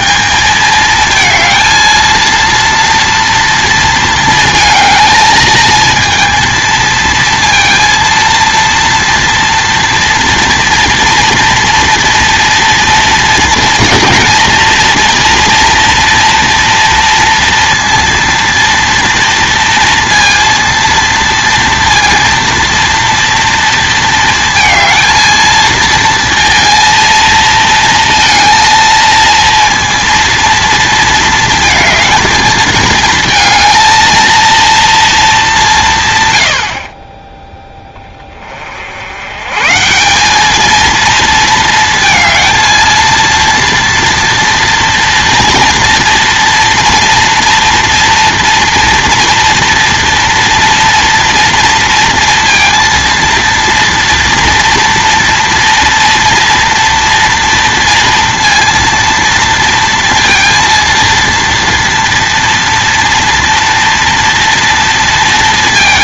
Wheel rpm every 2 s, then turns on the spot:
210, 230, 220, 230, 230, 230, 230, 240, 230, 230, 230, 230, 230, 230, 230, 230, 230, 230, 60, 60, 220, 230, 230, 230, 230, 230, 230, 230, 230, 230, 230, 230, 230.
none